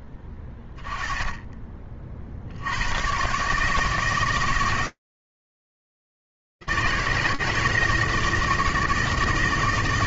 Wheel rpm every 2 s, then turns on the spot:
10, 130, 160, 160, 160.
none